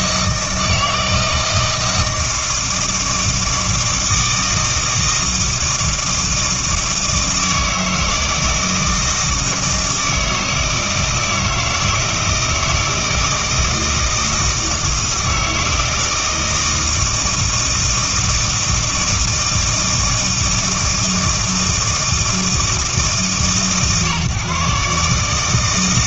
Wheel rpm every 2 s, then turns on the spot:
160, 160, 160, 160, 160, 160, 160, 160, 160, 160, 160, 150, 150.
none